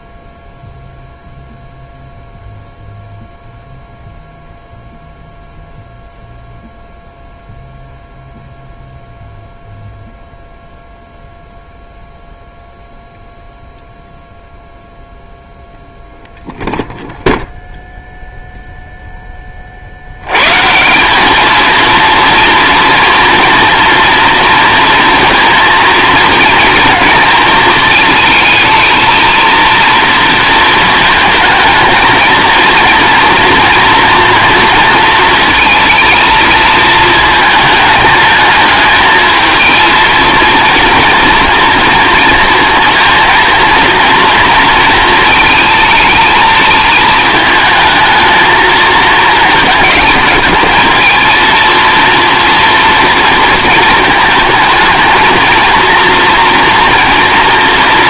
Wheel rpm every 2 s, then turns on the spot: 0, 0, 0, 0, 0, 0, 0, 0, 0, 0, 150, 230, 230, 230, 220, 230, 230, 230, 220, 220, 230, 230, 230, 220, 220, 220, 230, 220, 230.
none